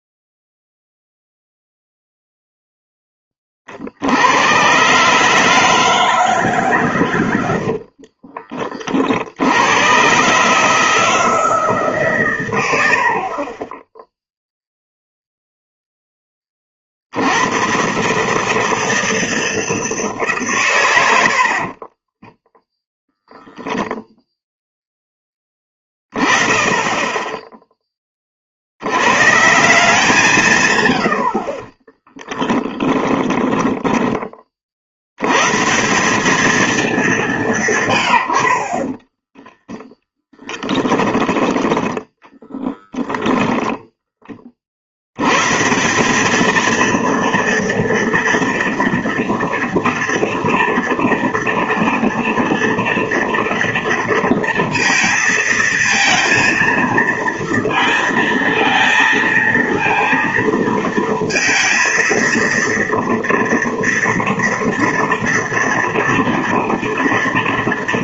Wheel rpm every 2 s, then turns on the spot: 0, 0, 110, 140, 40, 150, 110, 0, 30, 150, 130, 10, 10, 20, 60, 130, 10, 40, 210, 50, 10, 10, 40, 230, 230, 230, 230, 230, 230, 230, 230, 230, 230, 230.
32-34 40-42